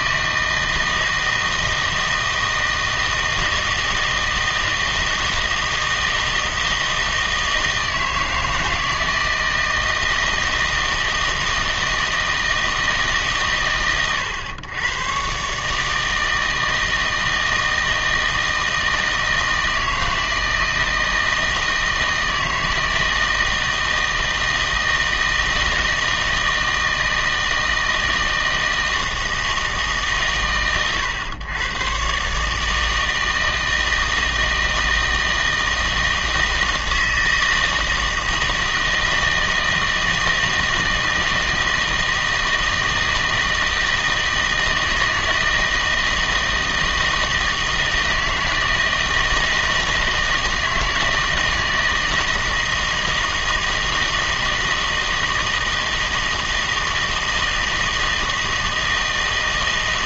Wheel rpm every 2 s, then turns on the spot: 160, 160, 160, 160, 160, 160, 160, 110, 160, 160, 160, 160, 160, 160, 160, 120, 150, 160, 160, 160, 160, 160, 160, 160, 160, 160, 160, 160, 160, 160.
none